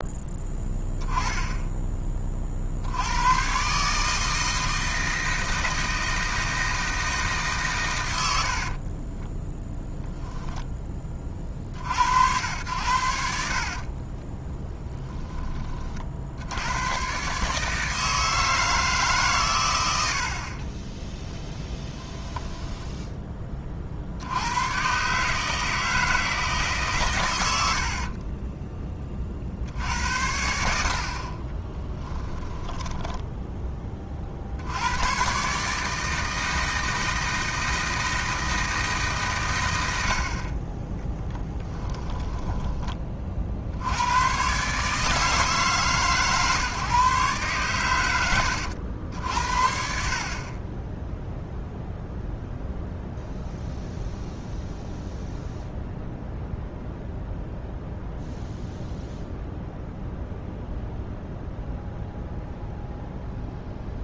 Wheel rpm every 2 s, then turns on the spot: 10, 70, 160, 160, 50, 20, 90, 20, 100, 160, 20, 10, 120, 140, 20, 70, 10, 90, 160, 160, 20, 30, 140, 140, 80, 10, 0, 0, 0, 0, 0, 0.
8-10 14-16 20-22 32-34